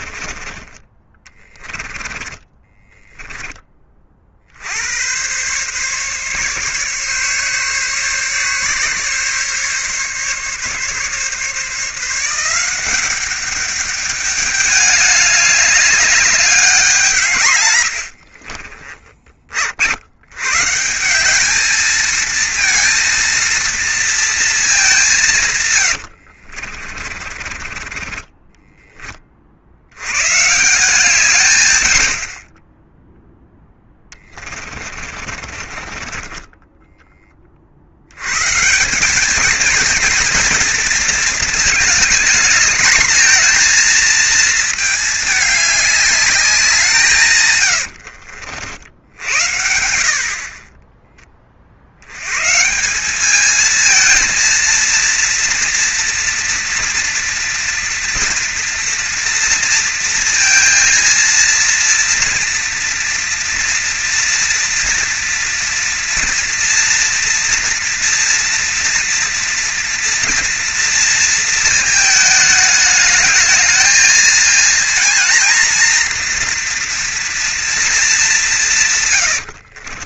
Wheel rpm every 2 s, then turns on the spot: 30, 20, 90, 140, 140, 140, 190, 210, 180, 20, 150, 230, 200, 50, 20, 170, 10, 30, 10, 160, 230, 220, 220, 160, 60, 30, 180, 230, 230, 230, 230, 230, 230, 230, 230, 230, 220, 230, 240, 150.
0-4 18-20 26-30 32-38